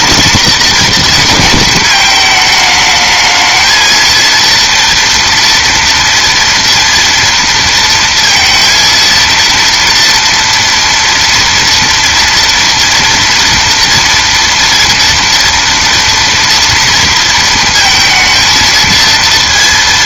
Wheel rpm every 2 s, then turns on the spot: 230, 220, 230, 230, 230, 230, 230, 230, 230, 230.
none